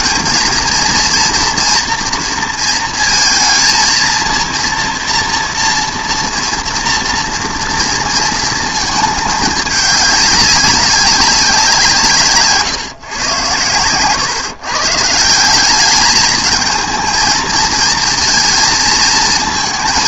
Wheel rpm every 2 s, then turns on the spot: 230, 230, 230, 230, 220, 200, 130, 130, 220, 230.
none